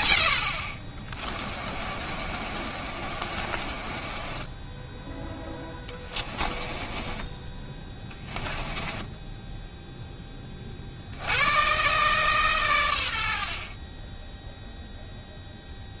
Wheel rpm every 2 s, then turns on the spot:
60, 40, 10, 30, 20, 40, 120, 0.
2-4 6-10